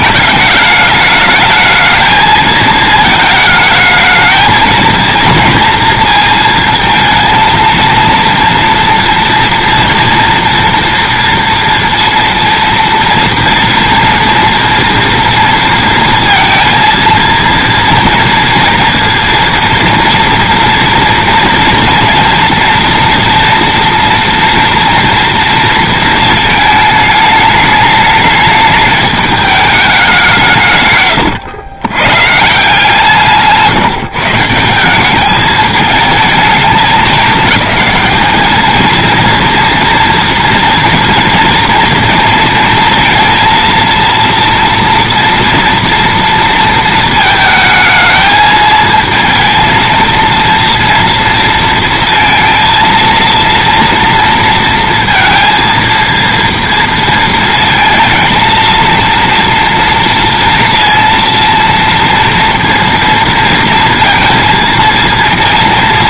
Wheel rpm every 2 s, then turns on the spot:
210, 220, 220, 230, 230, 230, 230, 230, 230, 230, 230, 230, 230, 220, 210, 150, 150, 170, 220, 220, 230, 230, 230, 230, 220, 230, 230, 230, 230, 230, 230, 230, 230.
none